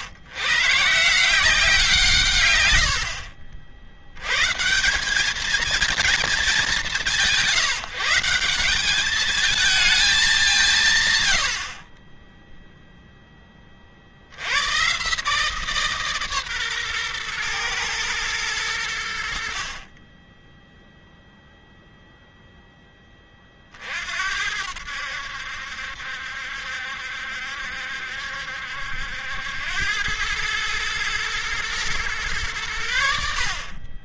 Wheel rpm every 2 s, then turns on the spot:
150, 60, 180, 190, 200, 170, 0, 120, 130, 80, 0, 10, 80, 70, 80, 110, 90.
none